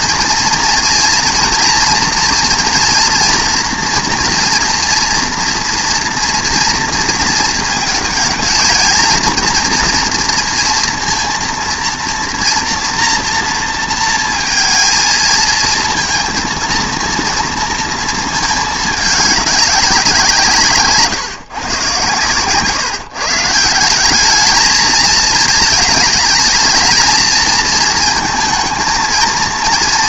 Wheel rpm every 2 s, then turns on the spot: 230, 240, 240, 240, 230, 230, 230, 220, 230, 210, 150, 140, 220, 220, 230.
none